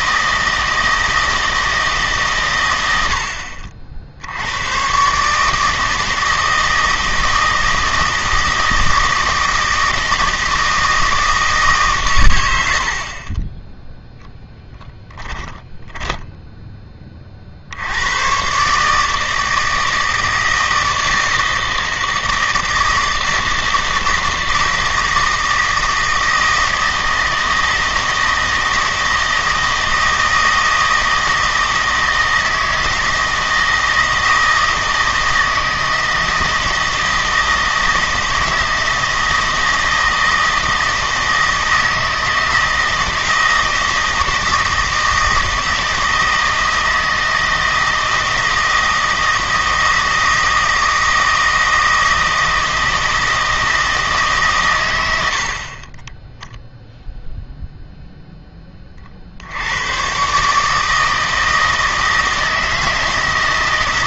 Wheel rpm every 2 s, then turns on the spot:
160, 100, 120, 160, 160, 160, 70, 0, 10, 140, 160, 160, 160, 160, 160, 160, 160, 160, 160, 160, 160, 160, 160, 160, 160, 160, 160, 120, 0, 30, 150, 160.
none